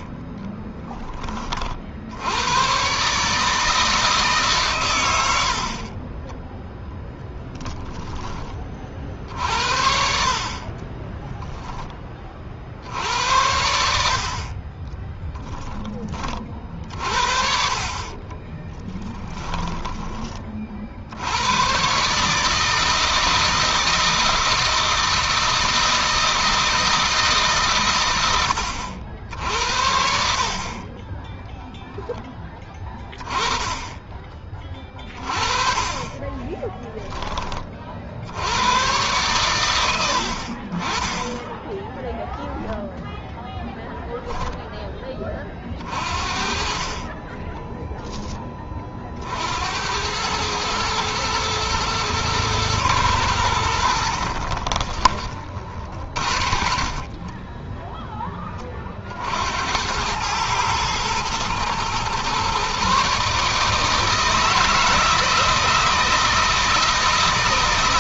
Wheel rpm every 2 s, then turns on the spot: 10, 120, 120, 0, 50, 30, 70, 20, 50, 20, 70, 160, 160, 160, 80, 20, 20, 20, 10, 120, 30, 10, 20, 30, 40, 110, 100, 30, 40, 50, 110, 140, 160, 160.
10-12 14-16 18-20 54-56